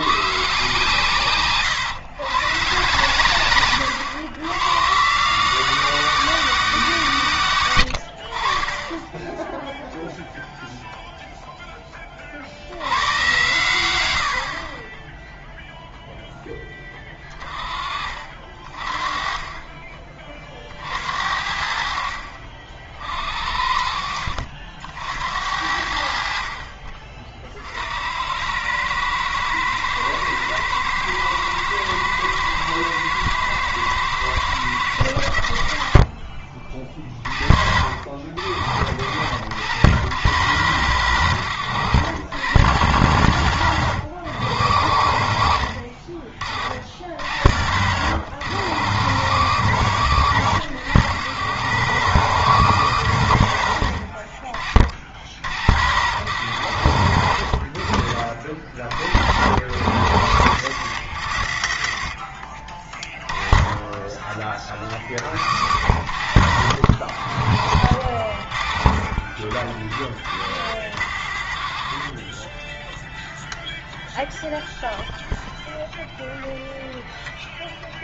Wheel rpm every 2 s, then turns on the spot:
140, 120, 120, 170, 30, 0, 60, 50, 10, 40, 40, 50, 60, 50, 100, 110, 110, 100, 40, 60, 110, 100, 90, 50, 100, 110, 120, 40, 100, 50, 90, 30, 30, 70, 50, 60, 20, 0, 0.
none